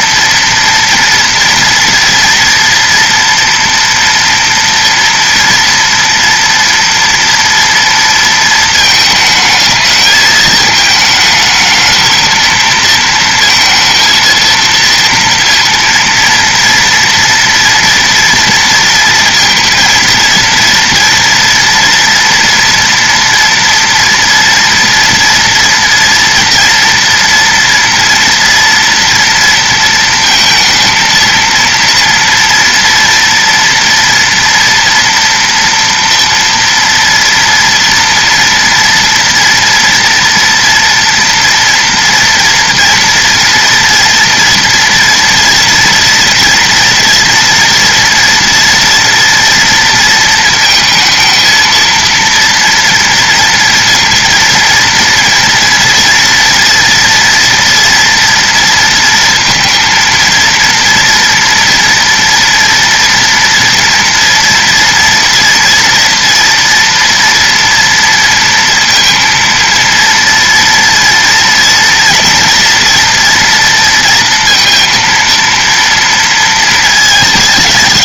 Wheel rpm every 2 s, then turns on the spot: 230, 240, 230, 230, 220, 220, 230, 230, 230, 230, 230, 240, 240, 230, 230, 230, 230, 230, 230, 230, 240, 230, 240, 230, 230, 230, 230, 230, 230, 230, 230, 230, 230, 230, 230, 230, 230, 230, 220.
none